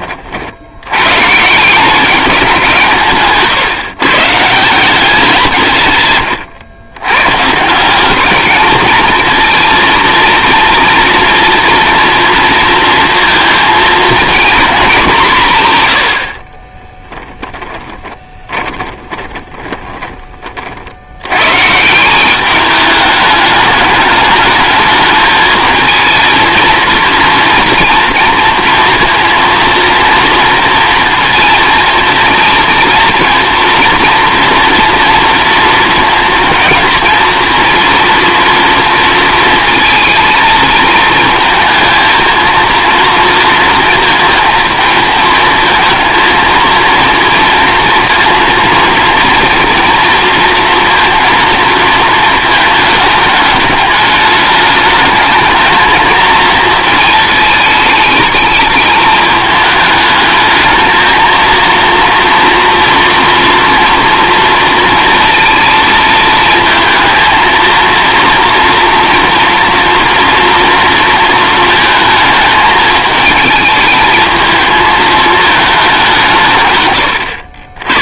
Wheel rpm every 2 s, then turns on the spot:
90, 170, 170, 110, 220, 230, 230, 220, 20, 20, 50, 210, 210, 230, 230, 230, 230, 230, 230, 230, 220, 230, 230, 230, 230, 230, 220, 210, 220, 220, 220, 230, 230, 220, 230, 230, 220, 220, 120.
16-20